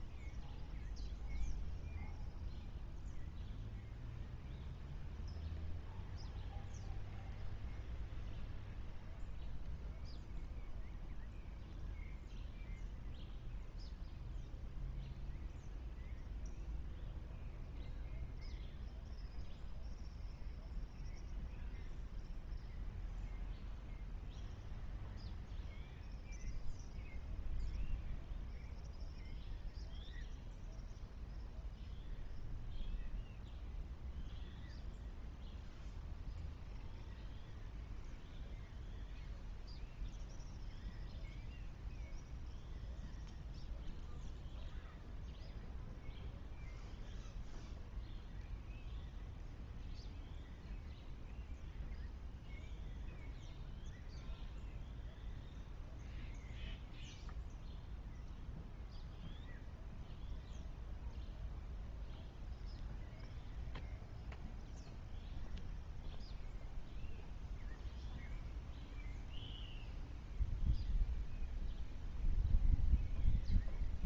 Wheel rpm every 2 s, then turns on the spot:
0, 0, 0, 0, 0, 0, 0, 0, 0, 0, 0, 0, 0, 0, 0, 0, 0, 0, 0, 0, 0, 0, 0, 0, 0, 0, 0, 0, 0, 0, 0, 0, 0, 0, 0, 0, 0.
none